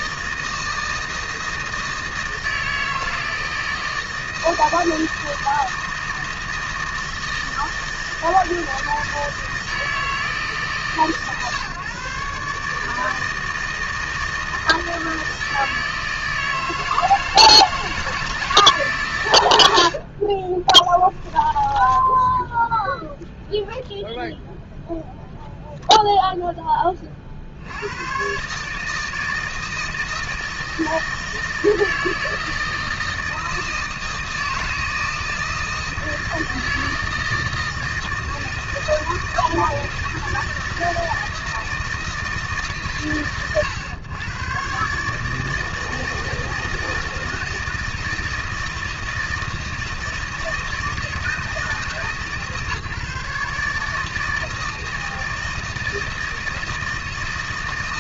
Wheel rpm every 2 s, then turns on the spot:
160, 160, 160, 160, 160, 150, 140, 160, 160, 160, 40, 10, 0, 0, 130, 160, 160, 160, 170, 160, 160, 160, 110, 160, 160, 160, 150, 160, 160.
20-22